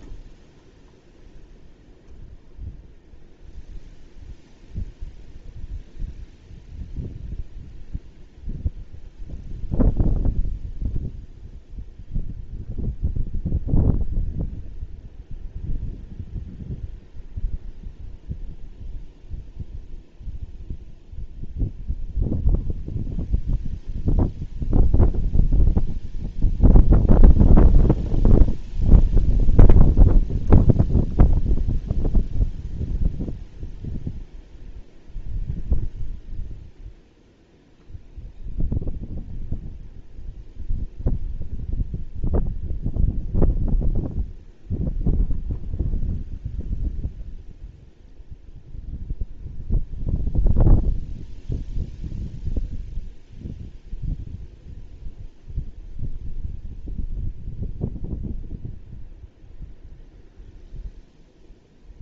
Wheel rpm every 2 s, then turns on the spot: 0, 0, 0, 0, 0, 0, 0, 0, 0, 0, 0, 0, 0, 0, 0, 0, 0, 0, 0, 0, 0, 0, 0, 0, 0, 0, 0, 0, 0, 0, 0.
none